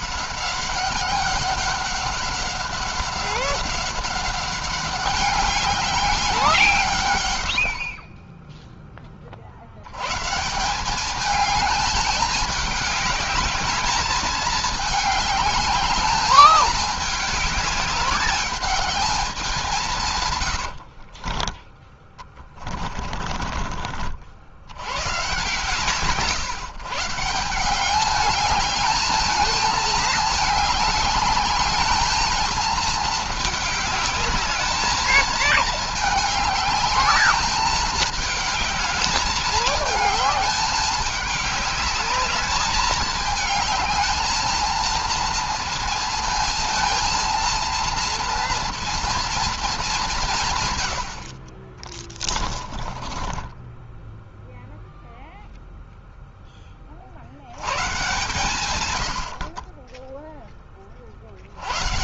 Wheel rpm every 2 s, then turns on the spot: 190, 190, 190, 180, 20, 150, 210, 210, 210, 200, 110, 20, 70, 130, 210, 220, 220, 210, 210, 210, 220, 210, 220, 230, 230, 160, 40, 0, 10, 120, 10.
20-24 52-54